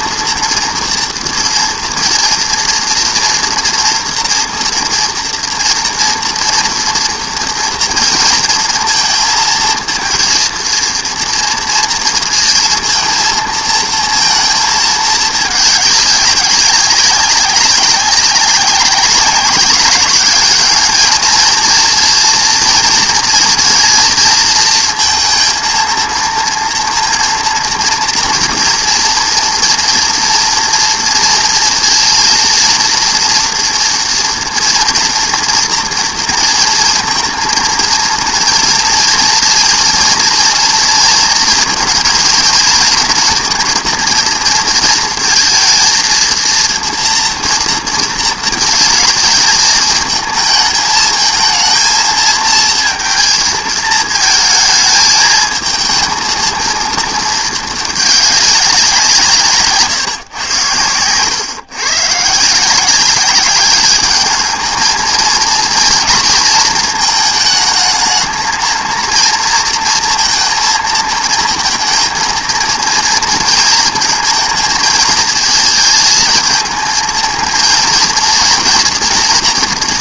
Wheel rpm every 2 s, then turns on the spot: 230, 230, 230, 230, 230, 230, 230, 230, 200, 190, 200, 230, 230, 230, 230, 230, 230, 230, 230, 230, 230, 230, 230, 230, 220, 220, 230, 220, 230, 210, 130, 140, 210, 230, 220, 230, 230, 230, 220, 230.
none